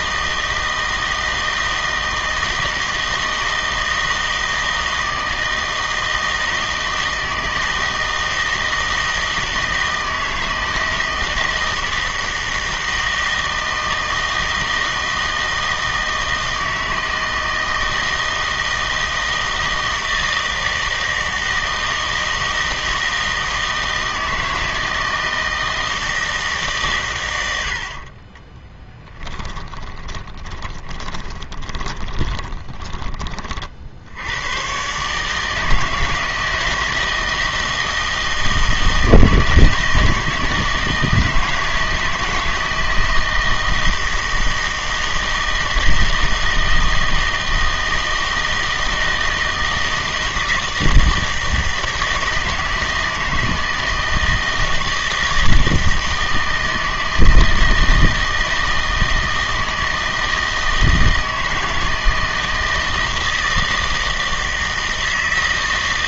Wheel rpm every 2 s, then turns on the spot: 160, 160, 160, 160, 160, 160, 160, 160, 160, 160, 160, 160, 160, 150, 20, 20, 10, 120, 160, 160, 160, 160, 160, 160, 160, 160, 160, 160, 160, 160, 160, 160, 160.
28-34